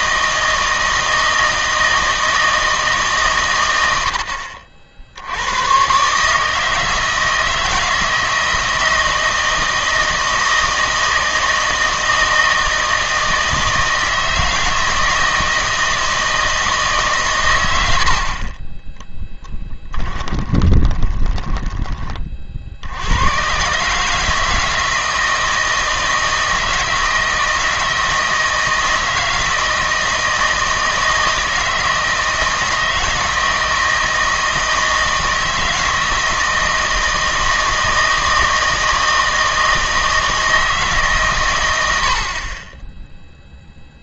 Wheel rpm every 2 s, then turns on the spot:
160, 160, 70, 150, 160, 160, 160, 160, 160, 40, 20, 50, 160, 160, 160, 160, 160, 160, 160, 160, 160, 20.
18-22